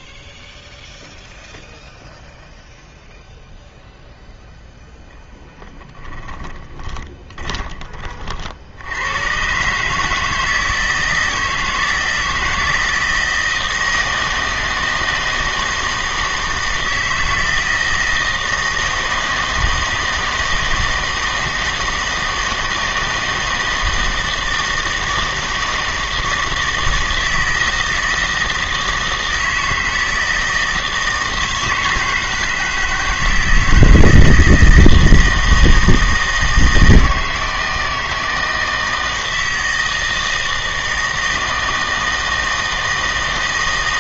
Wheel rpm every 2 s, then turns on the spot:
0, 0, 0, 10, 70, 160, 160, 160, 160, 160, 160, 160, 160, 160, 160, 160, 160, 160, 160, 160, 160, 160.
6-8